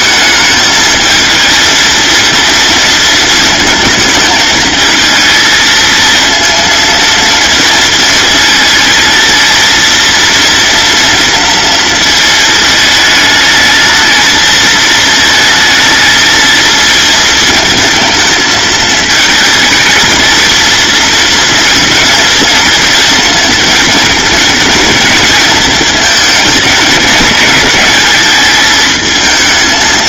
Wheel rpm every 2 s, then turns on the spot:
220, 230, 220, 230, 230, 230, 220, 220, 230, 220, 240, 230, 230, 220, 220.
none